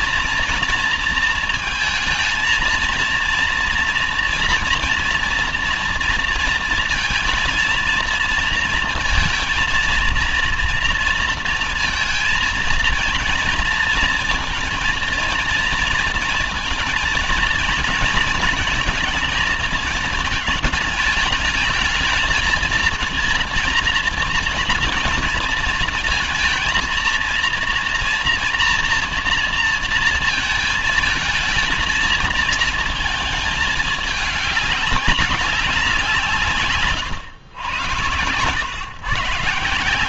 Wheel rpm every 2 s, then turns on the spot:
230, 230, 230, 230, 230, 230, 230, 230, 230, 230, 220, 230, 230, 230, 240, 230, 220, 200, 160, 120.
none